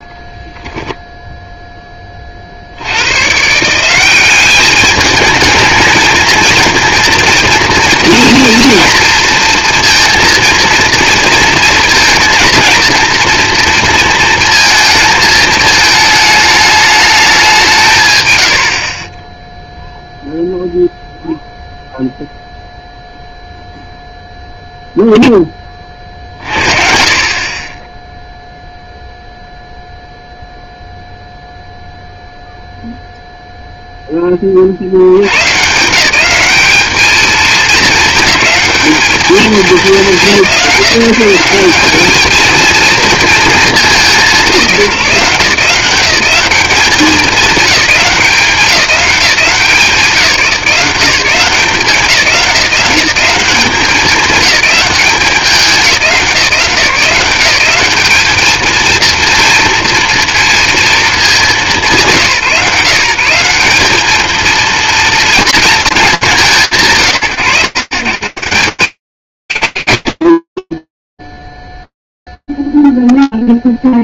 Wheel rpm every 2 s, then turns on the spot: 0, 70, 210, 230, 230, 230, 230, 230, 210, 80, 0, 0, 0, 50, 0, 0, 0, 50, 210, 220, 170, 220, 180, 210, 190, 190, 190, 190, 170, 220, 230, 160, 230, 140, 170, 30, 0.
70-72